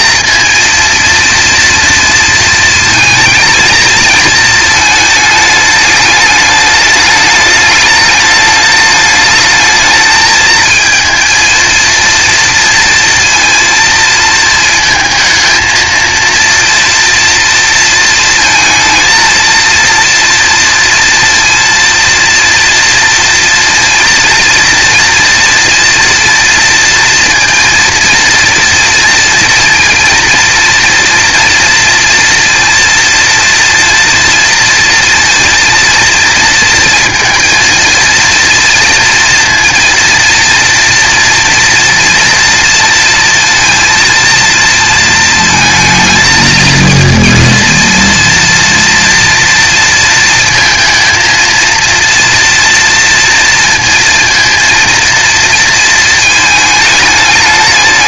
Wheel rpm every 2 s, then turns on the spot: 230, 230, 220, 210, 210, 220, 230, 230, 230, 220, 230, 230, 230, 230, 230, 230, 230, 230, 230, 240, 230, 230, 230, 220, 230, 230, 230, 230, 220.
none